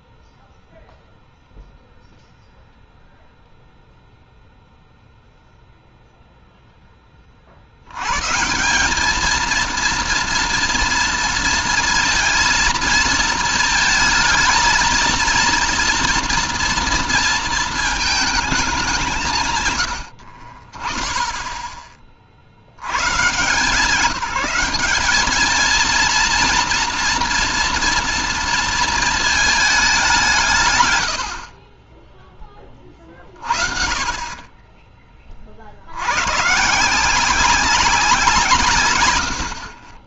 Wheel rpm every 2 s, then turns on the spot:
0, 0, 0, 20, 220, 230, 230, 230, 230, 150, 10, 140, 210, 240, 220, 90, 30, 20, 170, 130.
none